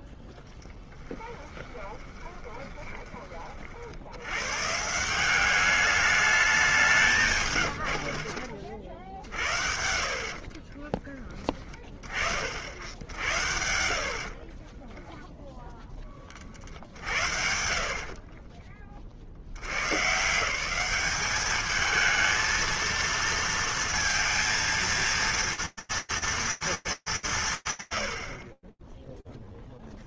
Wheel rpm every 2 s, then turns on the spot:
10, 20, 110, 200, 50, 40, 60, 40, 50, 40, 170, 220, 230, 230, 50.
2-4 10-12 14-16 18-20